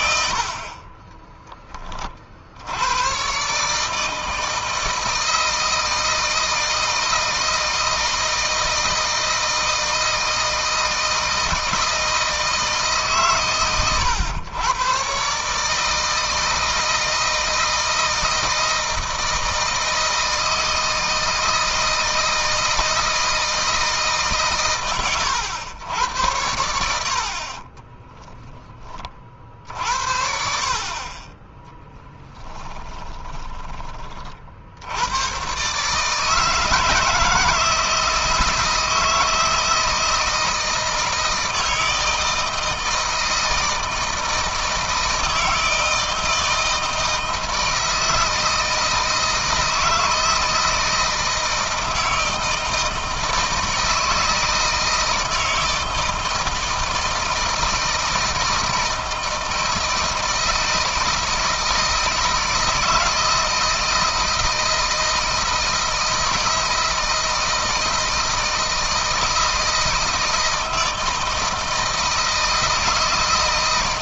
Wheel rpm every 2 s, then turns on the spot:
50, 70, 160, 160, 160, 160, 160, 120, 160, 160, 160, 160, 140, 90, 30, 50, 10, 60, 160, 160, 160, 160, 160, 160, 160, 160, 160, 160, 160, 160, 160, 160, 160, 160, 160, 160, 160.
28-30 32-34